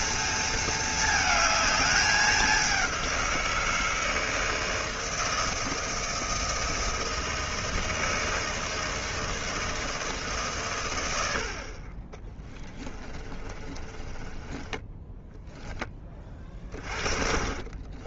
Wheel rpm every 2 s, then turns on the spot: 220, 180, 160, 160, 160, 100, 20, 10, 30.
12-18